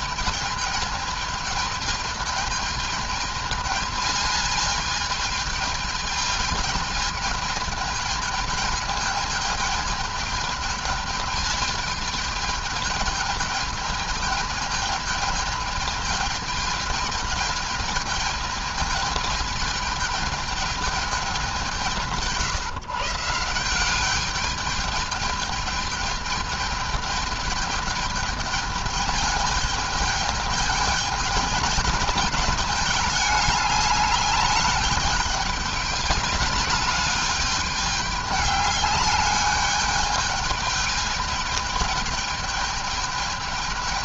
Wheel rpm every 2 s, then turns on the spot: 220, 220, 220, 220, 210, 220, 210, 220, 220, 220, 220, 150, 210, 210, 210, 210, 210, 210, 210, 200, 210, 210.
none